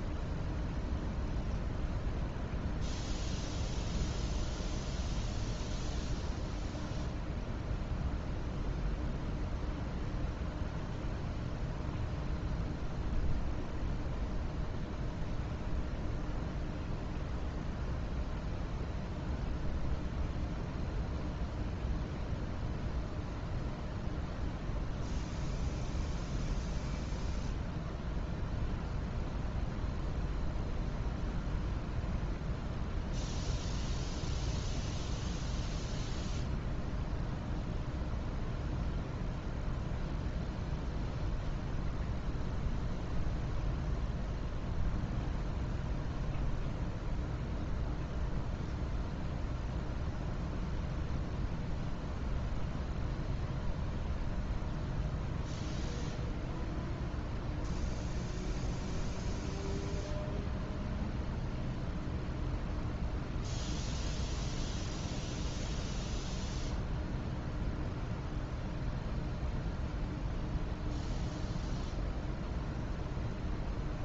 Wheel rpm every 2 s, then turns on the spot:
0, 0, 0, 0, 0, 0, 0, 0, 0, 0, 0, 0, 0, 0, 0, 0, 0, 0, 0, 0, 0, 0, 0, 0, 0, 0, 0, 0, 0, 0, 0, 0, 0, 0, 0, 0, 0.
none